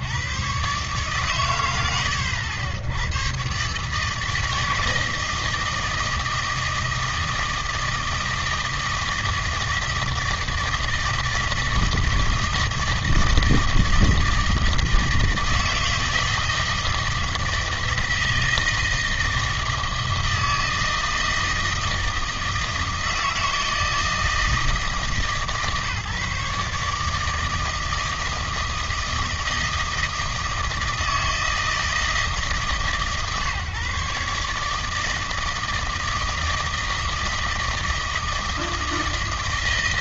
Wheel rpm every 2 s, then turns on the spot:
140, 100, 160, 160, 160, 160, 160, 160, 160, 160, 160, 160, 150, 150, 160, 160, 150, 160, 160, 160.
none